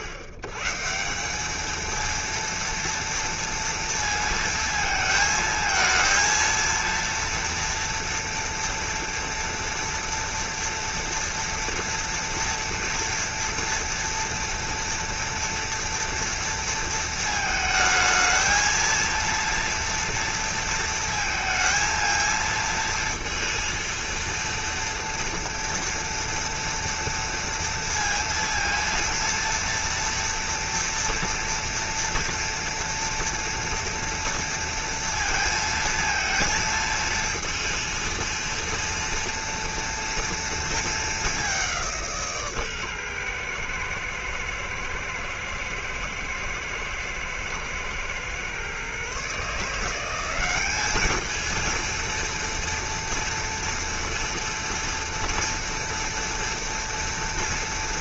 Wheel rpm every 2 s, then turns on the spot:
120, 230, 230, 230, 230, 230, 240, 230, 230, 220, 230, 230, 230, 230, 230, 230, 230, 230, 220, 230, 230, 140, 120, 110, 120, 200, 230, 230, 230.
none